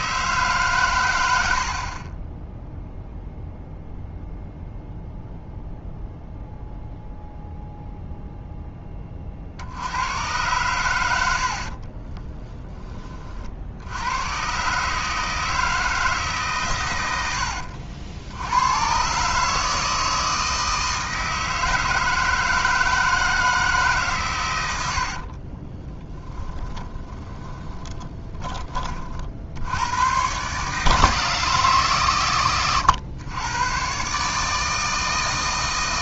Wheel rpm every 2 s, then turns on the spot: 150, 0, 0, 0, 10, 110, 20, 130, 130, 100, 160, 160, 90, 20, 30, 130, 120, 150.
12-14 26-28